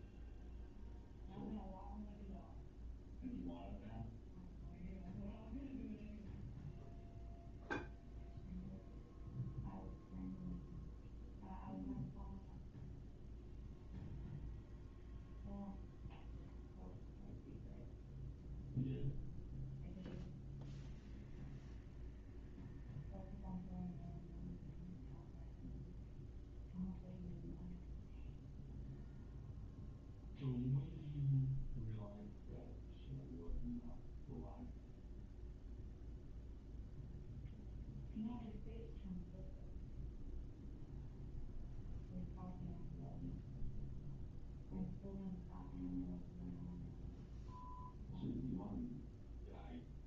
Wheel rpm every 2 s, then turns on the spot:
0, 0, 0, 0, 0, 0, 0, 0, 0, 0, 0, 0, 0, 0, 0, 0, 0, 0, 0, 0, 0, 0, 0, 0, 0.
none